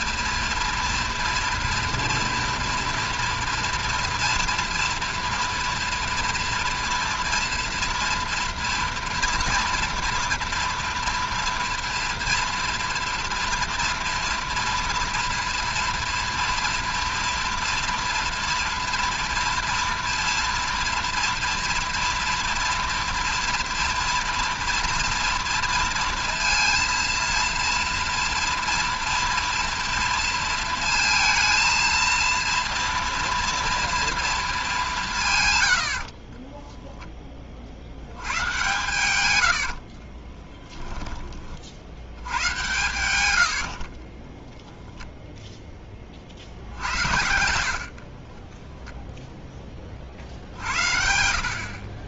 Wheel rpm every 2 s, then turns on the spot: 230, 230, 230, 230, 230, 230, 230, 230, 230, 240, 230, 230, 230, 230, 230, 230, 230, 220, 20, 110, 10, 110, 10, 70, 20, 70.
36-42 44-46 48-50